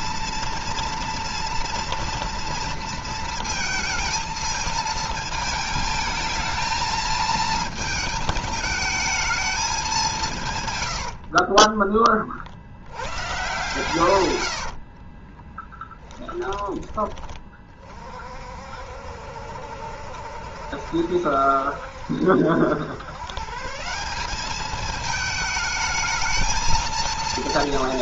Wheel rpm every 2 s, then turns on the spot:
230, 230, 220, 220, 220, 100, 80, 50, 20, 60, 70, 110, 210, 230.
10-12 14-16